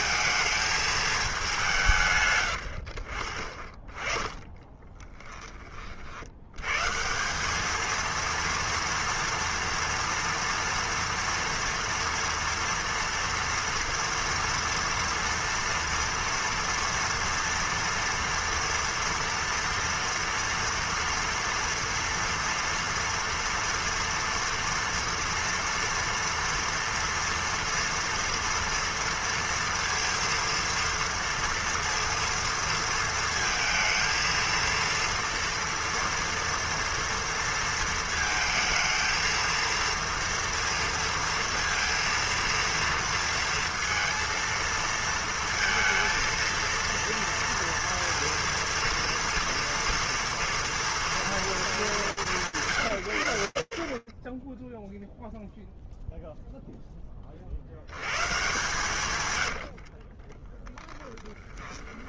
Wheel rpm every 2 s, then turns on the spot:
220, 80, 20, 100, 230, 230, 230, 230, 230, 230, 230, 230, 230, 230, 230, 230, 230, 230, 230, 220, 230, 230, 230, 230, 230, 230, 150, 20, 0, 130, 20.
4-6 60-62